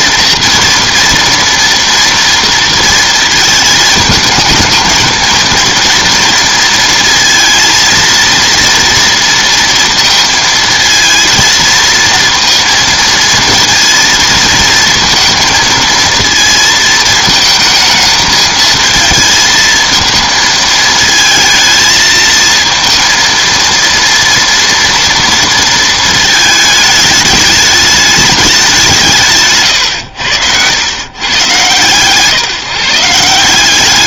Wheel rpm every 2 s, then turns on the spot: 240, 230, 220, 230, 230, 230, 230, 230, 230, 220, 220, 230, 230, 220, 200, 100, 160.
none